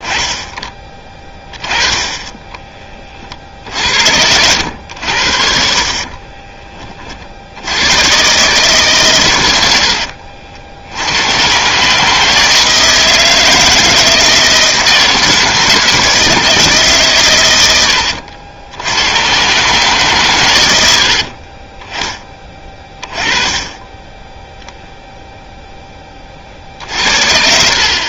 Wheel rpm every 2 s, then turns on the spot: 10, 20, 100, 30, 130, 70, 160, 160, 150, 80, 90, 20, 0, 50.
none